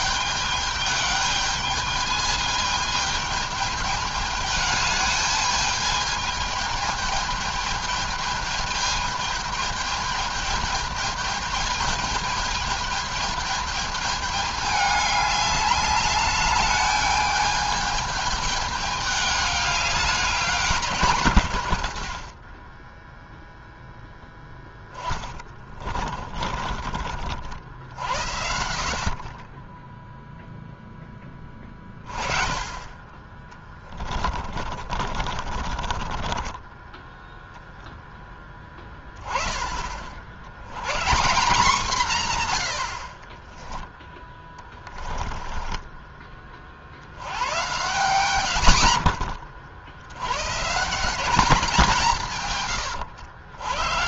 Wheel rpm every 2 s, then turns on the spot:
210, 210, 210, 220, 220, 210, 210, 210, 210, 210, 150, 20, 10, 50, 40, 10, 30, 50, 20, 10, 130, 80, 10, 60, 130, 180, 120.
24-26 34-38 44-46